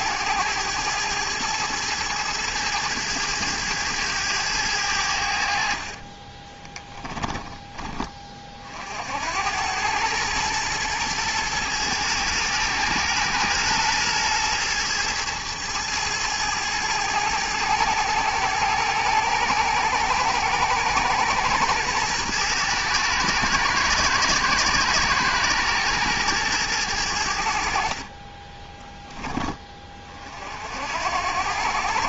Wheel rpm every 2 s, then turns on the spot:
110, 110, 100, 20, 40, 110, 110, 110, 110, 110, 110, 110, 110, 110, 30, 50.
6-8